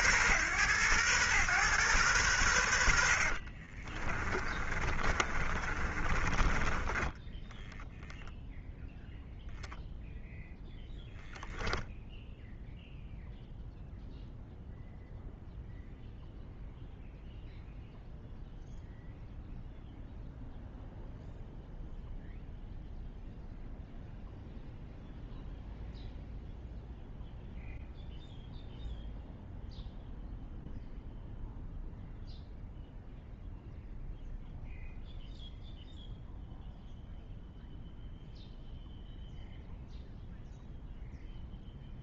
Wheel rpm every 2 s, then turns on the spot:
110, 70, 30, 10, 0, 0, 0, 0, 0, 0, 0, 0, 0, 0, 0, 0, 0, 0, 0, 0, 0.
2-8